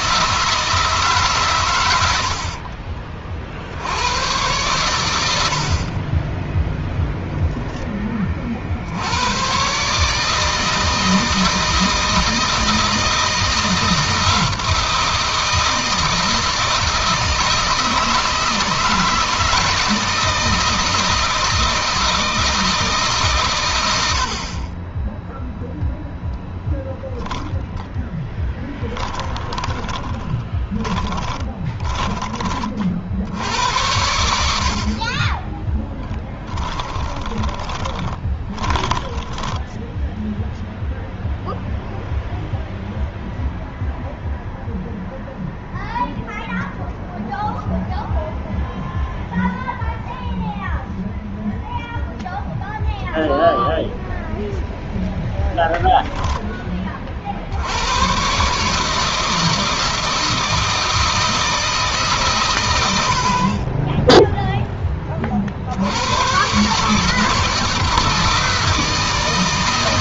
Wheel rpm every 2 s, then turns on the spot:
160, 40, 90, 0, 80, 160, 160, 170, 160, 160, 160, 150, 20, 10, 20, 10, 60, 60, 10, 10, 0, 0, 0, 0, 0, 0, 0, 0, 30, 150, 160, 80, 20, 140, 160.
28-32 34-40